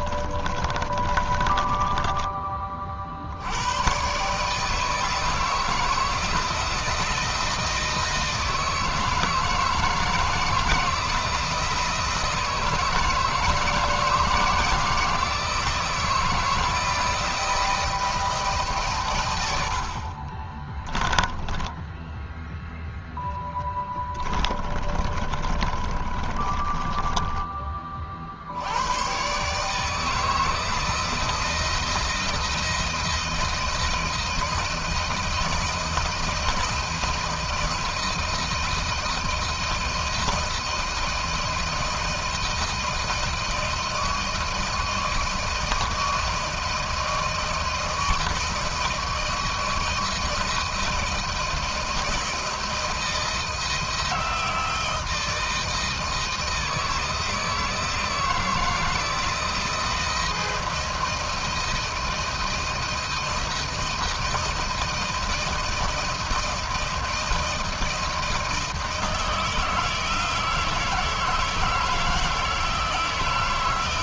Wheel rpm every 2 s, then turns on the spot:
30, 50, 160, 170, 160, 160, 160, 170, 160, 120, 10, 0, 30, 20, 110, 160, 170, 170, 160, 160, 160, 160, 170, 170, 160, 160, 170, 160, 160, 160, 170, 160, 160, 160, 160, 160, 160.
0-2 20-22 24-28